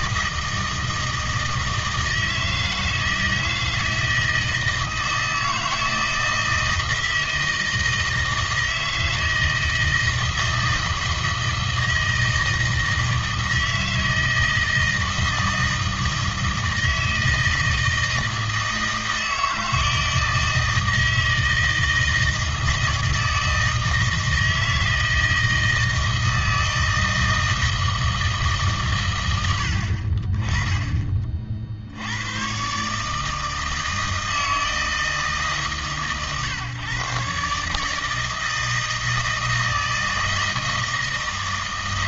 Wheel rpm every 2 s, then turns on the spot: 160, 160, 160, 160, 160, 160, 160, 160, 160, 160, 160, 160, 160, 160, 150, 20, 130, 160, 130, 160, 160.
none